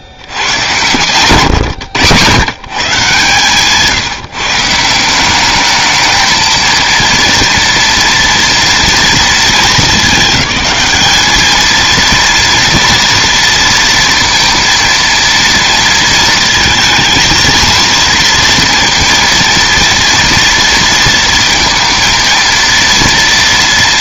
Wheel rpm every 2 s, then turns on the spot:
110, 130, 160, 220, 230, 210, 230, 230, 230, 230, 230, 230.
none